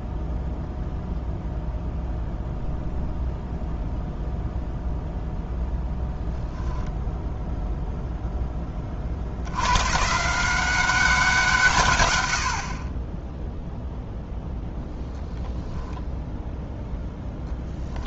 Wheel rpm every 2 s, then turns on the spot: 0, 0, 0, 10, 20, 180, 50, 0, 0.
none